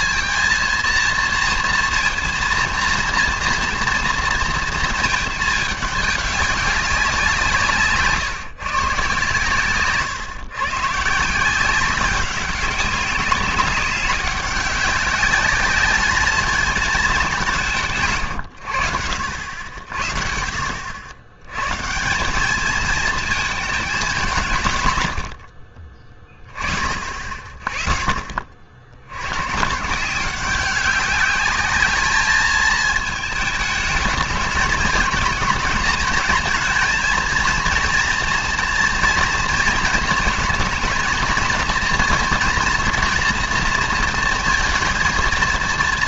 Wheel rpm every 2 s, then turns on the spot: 230, 230, 220, 190, 140, 140, 200, 200, 210, 90, 70, 220, 120, 50, 90, 200, 220, 220, 230, 230, 220, 240, 230.
none